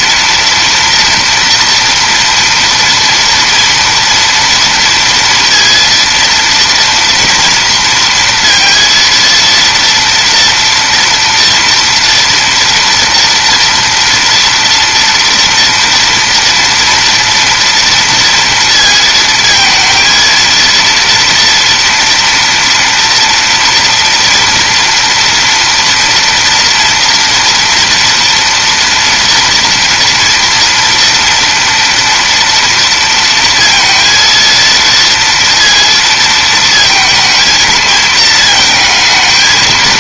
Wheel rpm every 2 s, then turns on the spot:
230, 230, 230, 230, 230, 230, 230, 230, 230, 230, 230, 230, 230, 230, 230, 230, 230, 230, 220, 220.
none